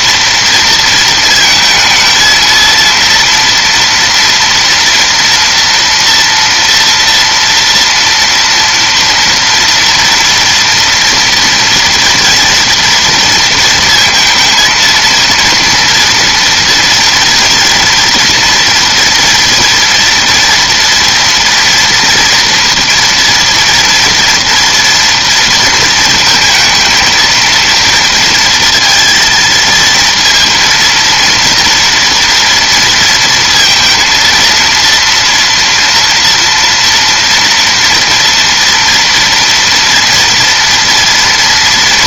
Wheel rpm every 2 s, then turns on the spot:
230, 230, 240, 230, 230, 230, 230, 230, 230, 230, 240, 230, 230, 230, 230, 230, 230, 230, 230, 230, 230.
none